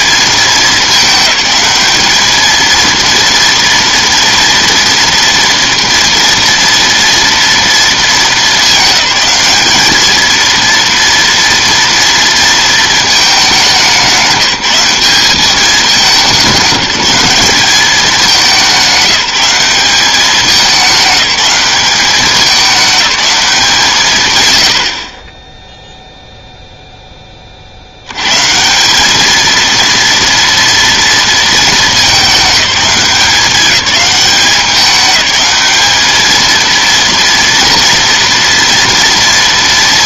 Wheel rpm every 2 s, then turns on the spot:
210, 220, 230, 230, 210, 230, 220, 190, 190, 190, 210, 200, 90, 0, 160, 230, 200, 200, 230, 230.
none